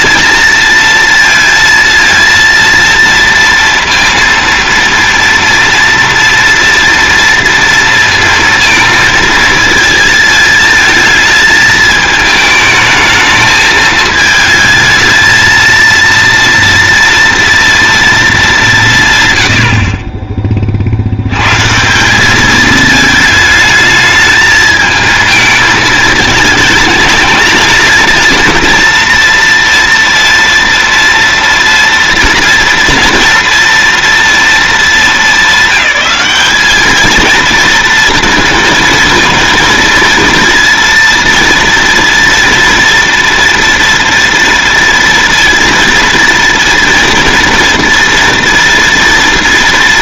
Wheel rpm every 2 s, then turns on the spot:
230, 230, 230, 230, 230, 220, 220, 220, 230, 180, 40, 210, 220, 220, 230, 230, 230, 220, 210, 230, 230, 230, 230, 230, 230.
none